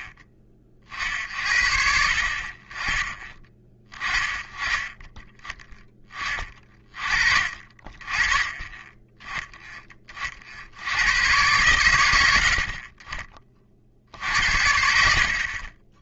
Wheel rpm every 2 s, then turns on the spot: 40, 30, 20, 30, 20, 70, 50, 60.
none